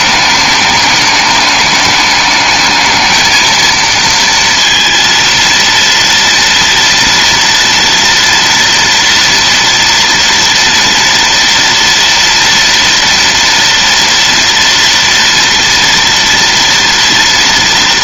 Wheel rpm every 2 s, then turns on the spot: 210, 210, 230, 230, 230, 230, 230, 230, 230.
none